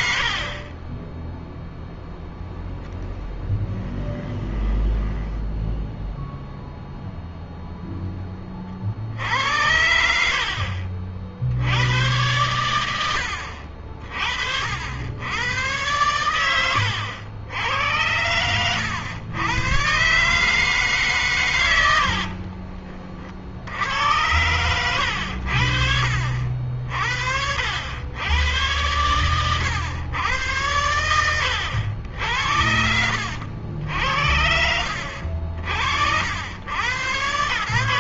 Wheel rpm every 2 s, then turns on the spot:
20, 10, 10, 0, 60, 50, 90, 90, 90, 100, 140, 40, 100, 60, 120, 110, 70, 70, 100.
2-6